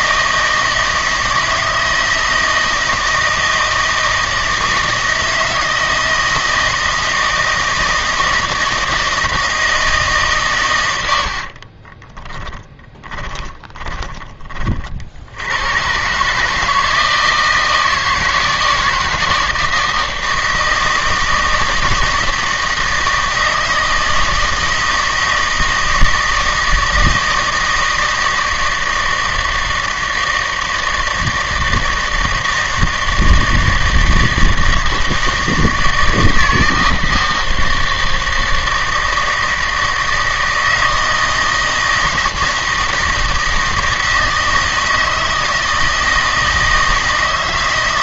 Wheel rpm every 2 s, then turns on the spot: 160, 160, 160, 160, 160, 120, 10, 40, 150, 160, 160, 160, 160, 160, 160, 160, 160, 160, 160, 160, 160, 160, 160, 160.
12-14